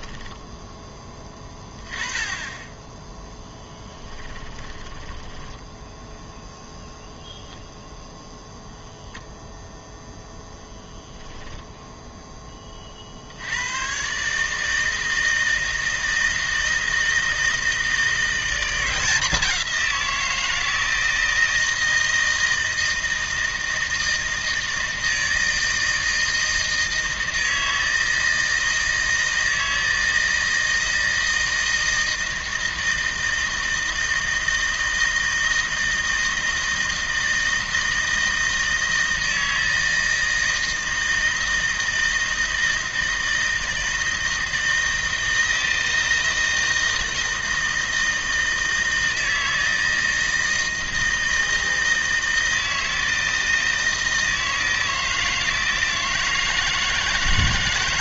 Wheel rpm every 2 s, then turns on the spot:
10, 10, 20, 0, 0, 0, 30, 160, 160, 180, 160, 160, 160, 160, 160, 160, 160, 160, 160, 160, 160, 160, 160, 160, 160, 160, 160, 160, 160.
4-6